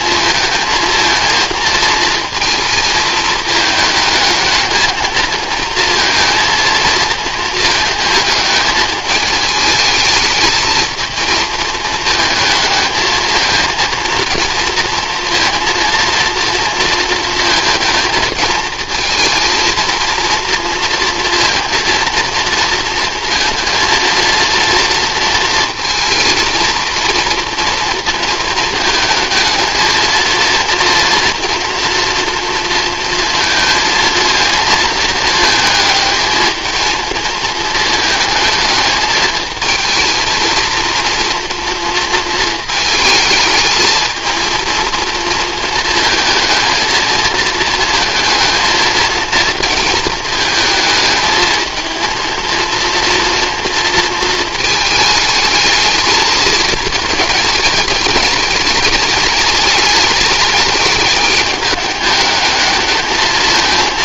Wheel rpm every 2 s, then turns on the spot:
230, 220, 220, 230, 220, 220, 220, 230, 230, 230, 230, 230, 230, 230, 220, 230, 230, 220, 220, 220, 230, 220, 230, 220, 220, 220, 230, 220, 220, 210, 210, 210.
none